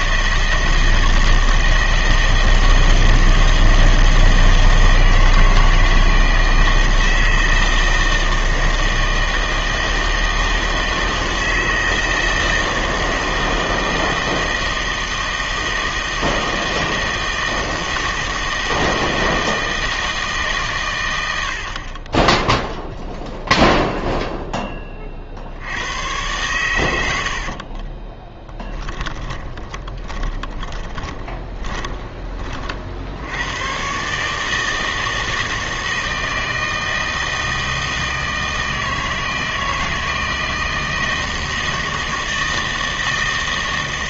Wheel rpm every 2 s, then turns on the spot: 160, 160, 160, 160, 160, 160, 160, 160, 160, 160, 130, 0, 10, 100, 10, 30, 40, 160, 160, 160, 160, 160.
28-32